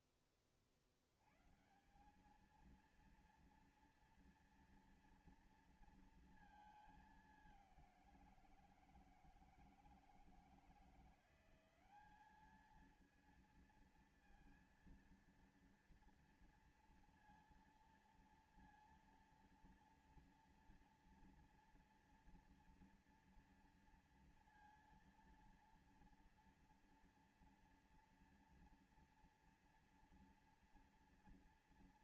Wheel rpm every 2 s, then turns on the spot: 30, 190, 230, 230, 180, 160, 200, 230, 230, 230, 230, 230, 230, 230, 230, 240.
none